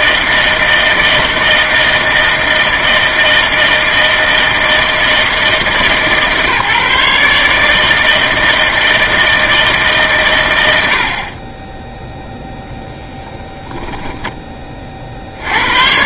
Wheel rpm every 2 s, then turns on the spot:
160, 160, 160, 150, 160, 80, 10, 40.
none